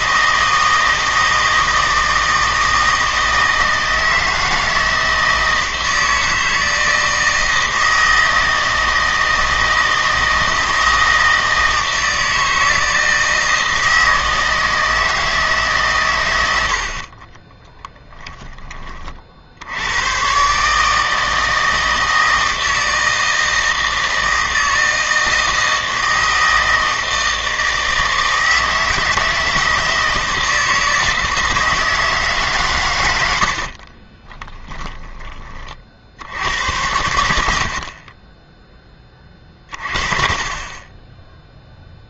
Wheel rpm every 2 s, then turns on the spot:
160, 160, 160, 160, 160, 160, 160, 160, 80, 20, 150, 160, 160, 160, 160, 160, 120, 10, 90, 10, 20.
16-18 34-36